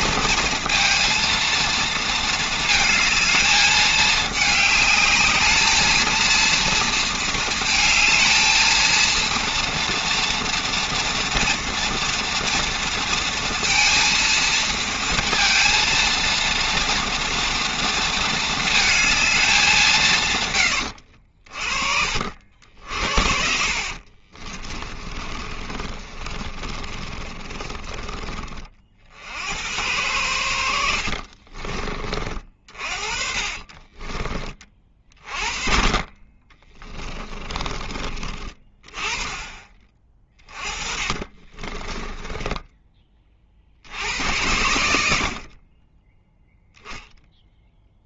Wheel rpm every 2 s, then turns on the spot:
230, 220, 220, 230, 220, 230, 230, 230, 230, 220, 110, 60, 30, 30, 30, 80, 40, 30, 30, 30, 40, 20, 90, 0.
24-28 36-38 40-44